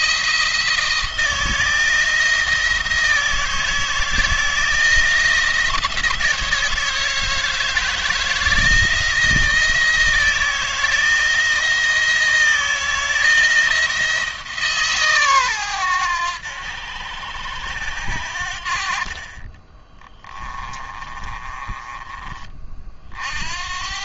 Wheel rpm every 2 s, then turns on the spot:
160, 160, 170, 160, 170, 170, 160, 140, 90, 50, 30, 50.
18-22